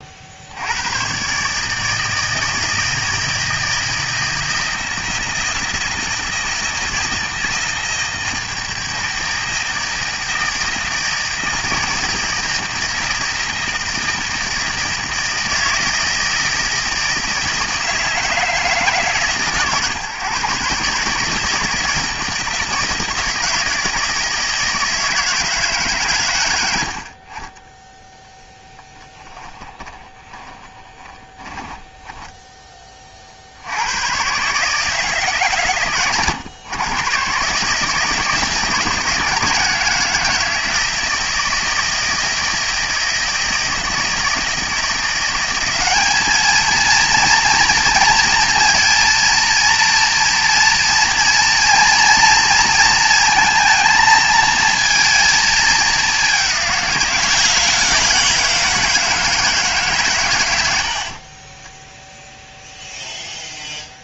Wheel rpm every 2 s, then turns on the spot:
80, 160, 160, 160, 160, 160, 160, 160, 160, 160, 130, 160, 160, 100, 10, 20, 10, 130, 120, 160, 160, 160, 160, 220, 230, 230, 230, 230, 190, 160, 100, 0.
30-32